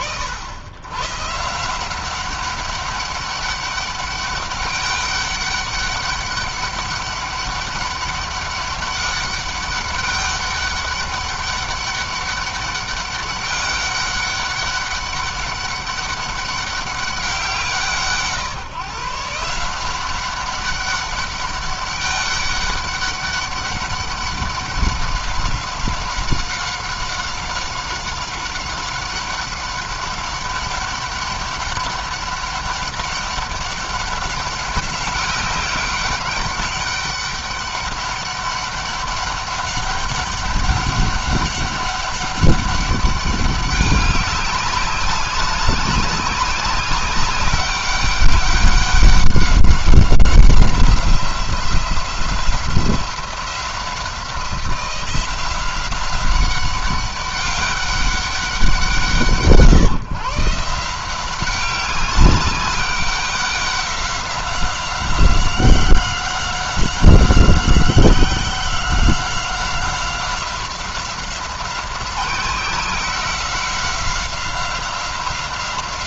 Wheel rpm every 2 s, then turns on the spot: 100, 190, 200, 200, 200, 200, 200, 200, 200, 150, 200, 200, 200, 190, 190, 200, 200, 190, 200, 200, 190, 200, 200, 200, 200, 180, 180, 180, 200, 180, 160, 190, 190, 190, 180, 190, 180, 190.
none